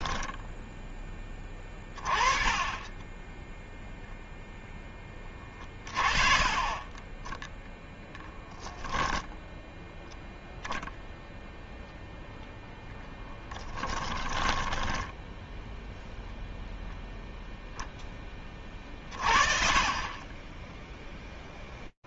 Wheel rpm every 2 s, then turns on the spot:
10, 20, 10, 40, 20, 0, 0, 10, 0, 30, 20.
14-16